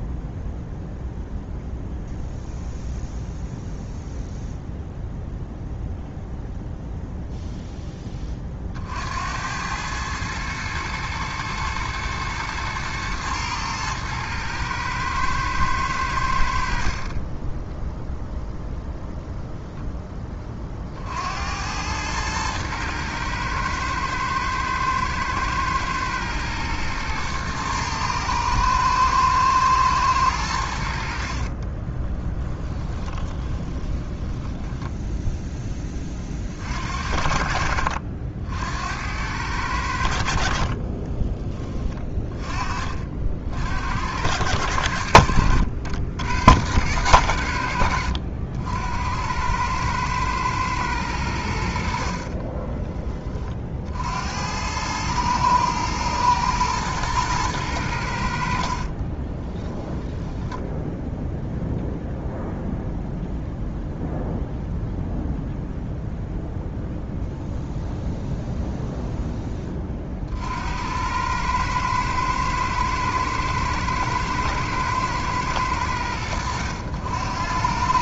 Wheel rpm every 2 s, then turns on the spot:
0, 0, 0, 0, 60, 110, 110, 110, 50, 0, 50, 110, 110, 120, 110, 70, 20, 10, 60, 80, 30, 40, 80, 110, 80, 110, 20, 100, 120, 40, 0, 0, 0, 0, 0, 90, 110, 110, 80.
32-34 40-42 58-60